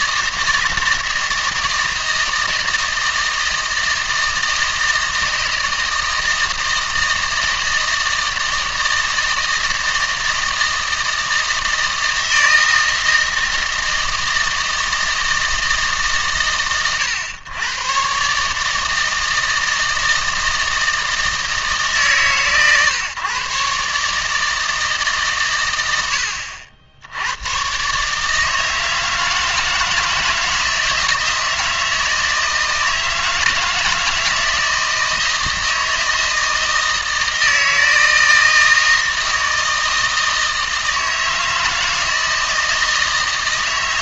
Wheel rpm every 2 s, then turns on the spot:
160, 160, 160, 160, 160, 160, 160, 160, 120, 150, 160, 130, 150, 80, 160, 160, 160, 160, 160, 160, 160, 160.
none